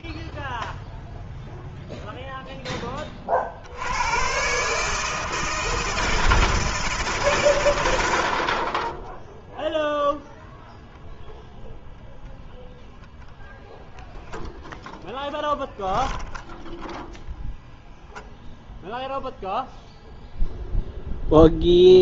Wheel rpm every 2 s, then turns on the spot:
0, 0, 100, 160, 70, 0, 0, 0, 0, 0, 0.
none